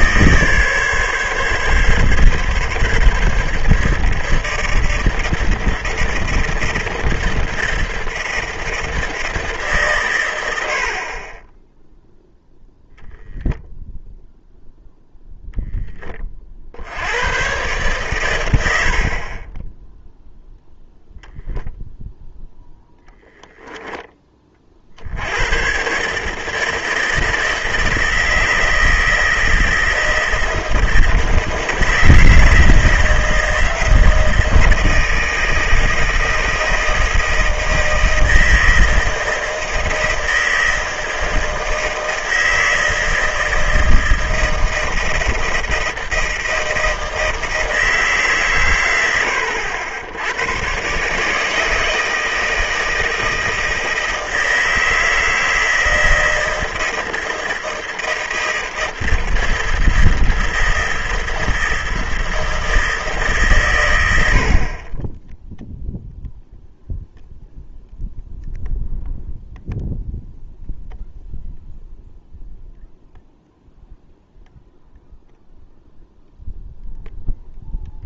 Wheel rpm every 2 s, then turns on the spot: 140, 140, 160, 160, 160, 70, 0, 0, 60, 100, 0, 0, 50, 160, 160, 160, 160, 160, 160, 160, 160, 160, 160, 160, 120, 110, 160, 160, 160, 160, 160, 160, 30, 0, 0, 0, 0, 0, 0.
none